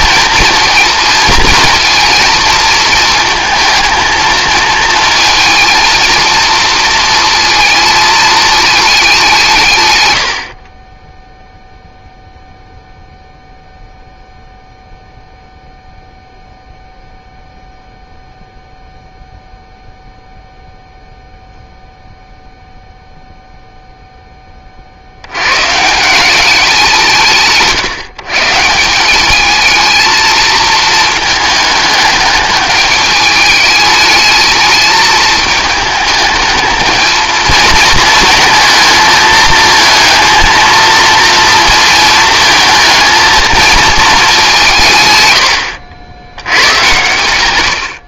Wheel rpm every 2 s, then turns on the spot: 230, 220, 220, 220, 210, 30, 0, 0, 0, 0, 0, 0, 40, 180, 180, 220, 210, 210, 220, 230, 230, 220, 150, 110.
none